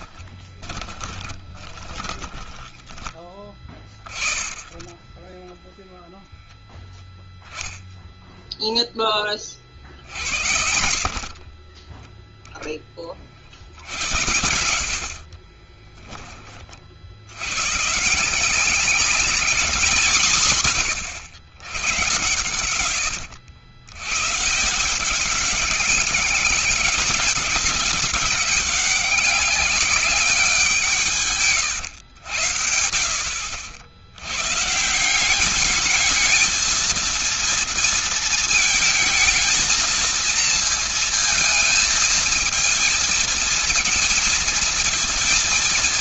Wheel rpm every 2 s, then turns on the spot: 20, 20, 10, 0, 20, 40, 40, 60, 80, 200, 120, 90, 180, 190, 190, 160, 70, 160, 230, 230, 230, 220, 220.
0-2 14-16